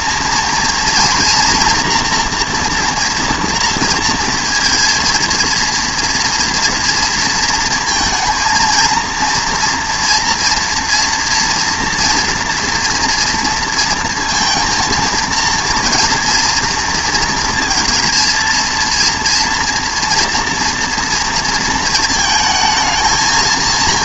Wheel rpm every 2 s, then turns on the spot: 240, 240, 230, 230, 230, 230, 230, 230, 230, 230, 230, 220.
none